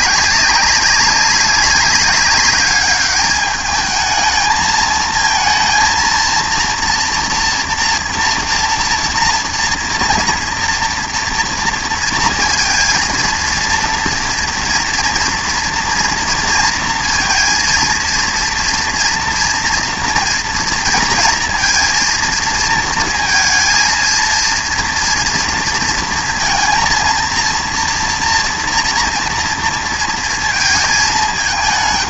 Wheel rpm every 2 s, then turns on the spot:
190, 200, 220, 230, 230, 230, 230, 230, 230, 240, 230, 230, 230, 230, 230, 220.
none